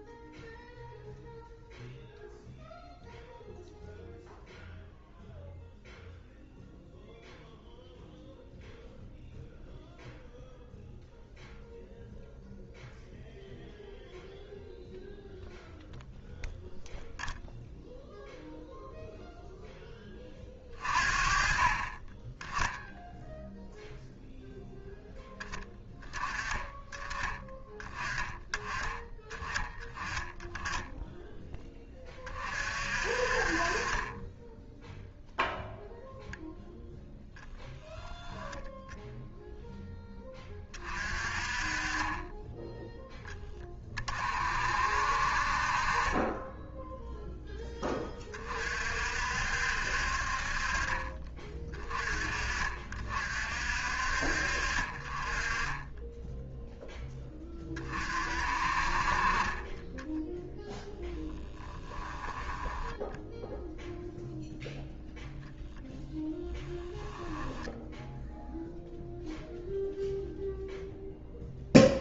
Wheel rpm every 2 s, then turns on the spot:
0, 0, 0, 0, 0, 0, 0, 0, 0, 0, 40, 0, 0, 20, 10, 10, 40, 0, 10, 10, 30, 10, 60, 10, 40, 40, 40, 40, 0, 40, 0, 10, 0, 10, 0, 0.
62-64 66-68